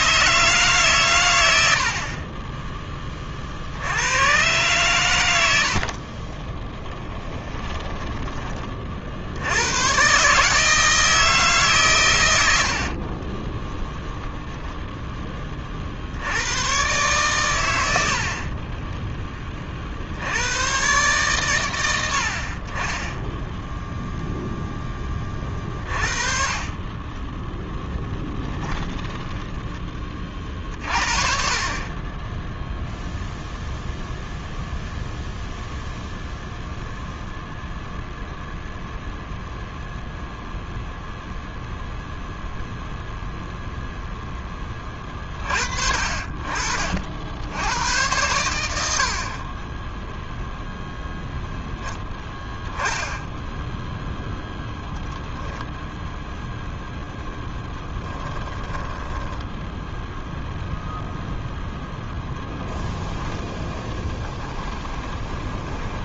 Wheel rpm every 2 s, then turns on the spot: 120, 20, 120, 10, 40, 160, 60, 0, 110, 20, 120, 30, 10, 20, 10, 40, 0, 0, 0, 0, 0, 0, 20, 50, 60, 0, 10, 0, 0, 20, 0, 10, 10.
6-8 12-14 18-20 28-30 58-60 62-66